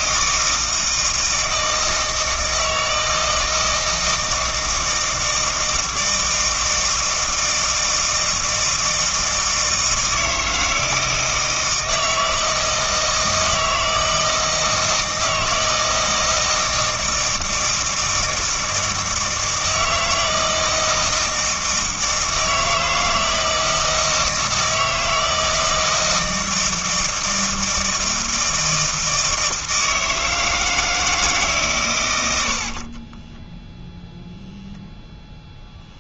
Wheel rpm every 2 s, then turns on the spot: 160, 160, 160, 160, 160, 160, 160, 160, 160, 160, 160, 160, 160, 160, 160, 160, 50, 0.
32-34